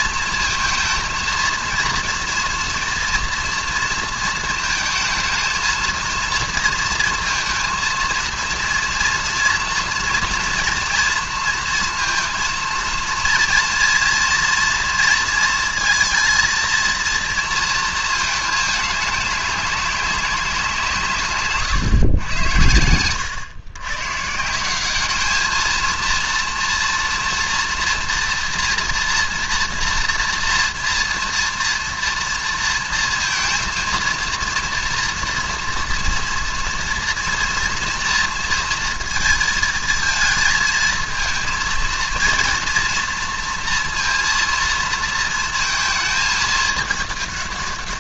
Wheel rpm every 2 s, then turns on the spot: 230, 230, 230, 230, 230, 230, 230, 230, 230, 210, 180, 100, 180, 230, 230, 230, 230, 230, 230, 230, 220, 240, 230, 210.
none